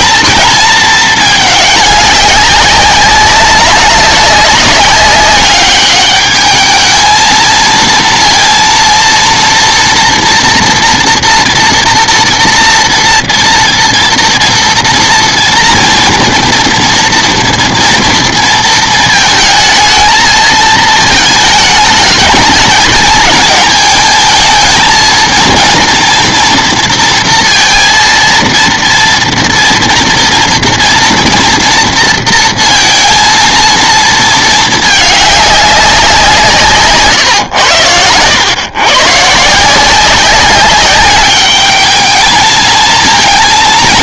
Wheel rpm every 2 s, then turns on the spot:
220, 190, 200, 220, 230, 230, 230, 230, 230, 220, 220, 220, 220, 230, 230, 230, 230, 220, 140, 120, 200, 220.
36-38